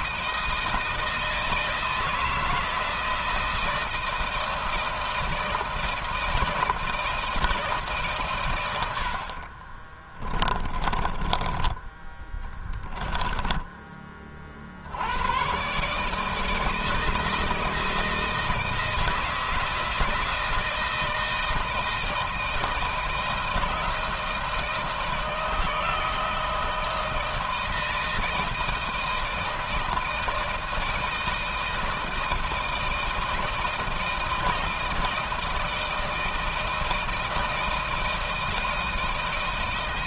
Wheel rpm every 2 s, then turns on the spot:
160, 160, 160, 160, 60, 20, 10, 100, 160, 160, 160, 170, 160, 160, 160, 160, 160, 160, 160, 160.
8-14